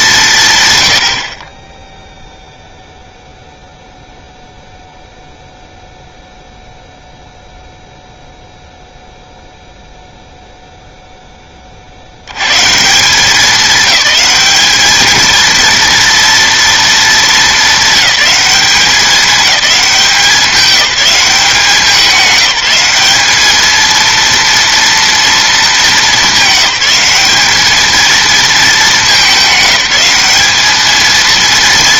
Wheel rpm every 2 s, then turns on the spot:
200, 0, 0, 0, 0, 0, 120, 210, 230, 200, 180, 190, 230, 210, 220, 210.
none